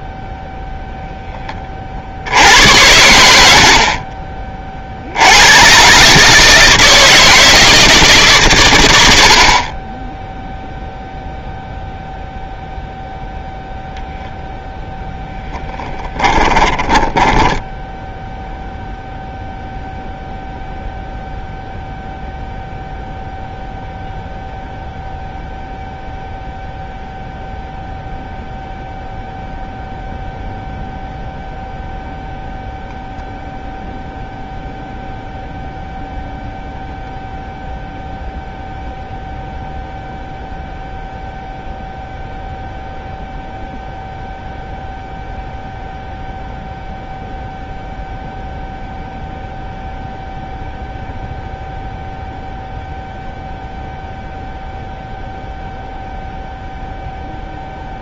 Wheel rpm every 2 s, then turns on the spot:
0, 90, 40, 160, 110, 0, 0, 0, 20, 0, 0, 0, 0, 0, 0, 0, 0, 0, 0, 0, 0, 0, 0, 0, 0, 0, 0, 0, 0.
16-18